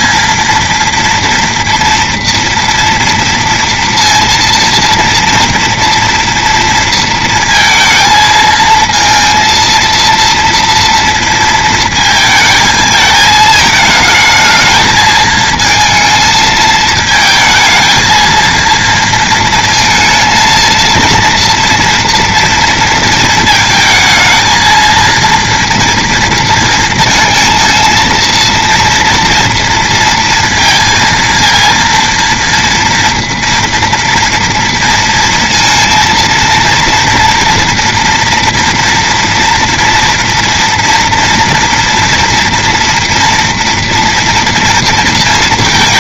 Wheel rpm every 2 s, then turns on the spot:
230, 230, 230, 230, 230, 230, 220, 220, 220, 230, 230, 230, 220, 230, 230, 230, 230, 230, 230, 230, 230, 230, 230.
none